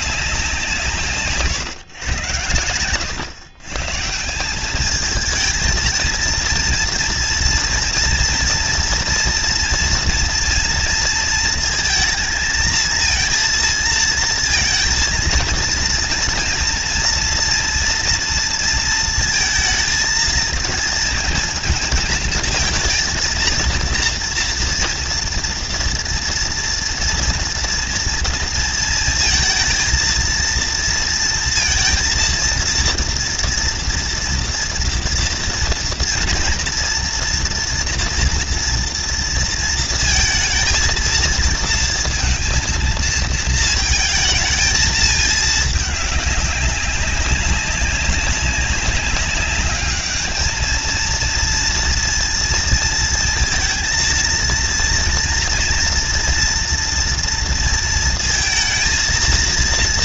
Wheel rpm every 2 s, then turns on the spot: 180, 100, 160, 230, 230, 230, 220, 230, 230, 230, 230, 230, 230, 230, 230, 230, 230, 240, 240, 230, 220, 230, 220, 200, 200, 210, 230, 230, 230, 230.
none